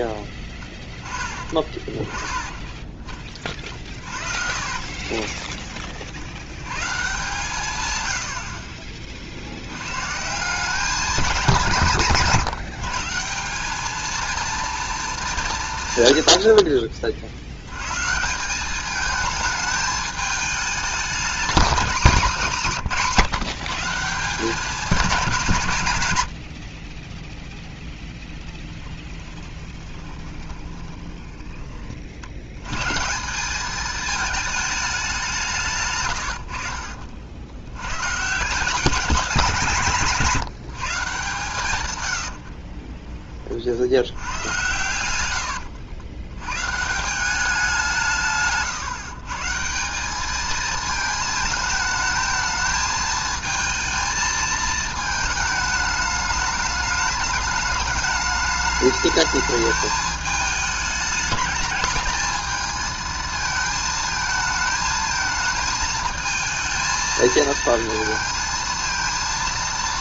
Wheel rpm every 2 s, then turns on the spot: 10, 20, 40, 110, 40, 180, 160, 230, 70, 190, 210, 190, 190, 50, 10, 20, 120, 210, 60, 170, 160, 40, 110, 120, 140, 220, 220, 220, 210, 210, 210, 220, 220, 220, 230.
2-6 28-32 42-44 48-50